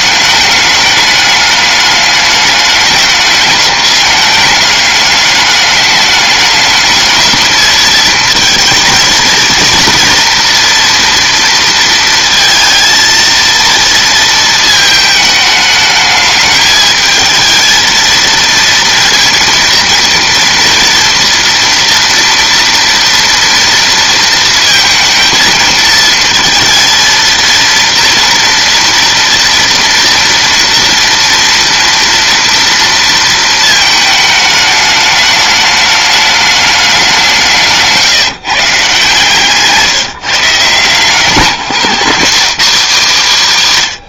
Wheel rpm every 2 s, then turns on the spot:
210, 210, 200, 210, 230, 230, 230, 220, 210, 230, 230, 230, 220, 230, 230, 230, 230, 210, 190, 150, 160, 240.
none